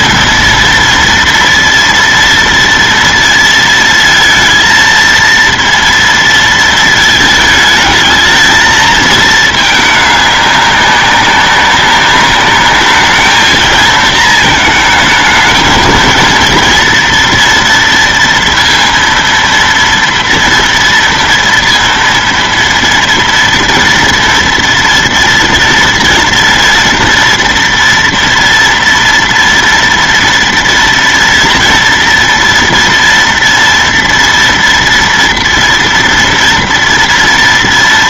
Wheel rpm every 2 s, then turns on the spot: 230, 230, 230, 230, 220, 200, 200, 220, 230, 230, 230, 230, 230, 230, 230, 230, 230, 230, 230.
none